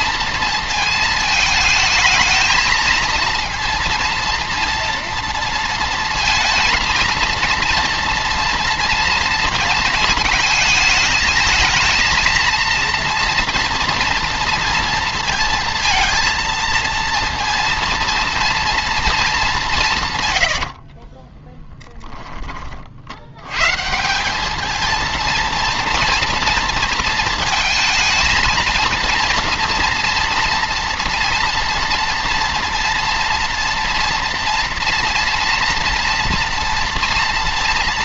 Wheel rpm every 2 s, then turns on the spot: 230, 220, 230, 230, 230, 220, 230, 230, 230, 230, 80, 30, 220, 230, 230, 240, 240, 230, 240.
20-22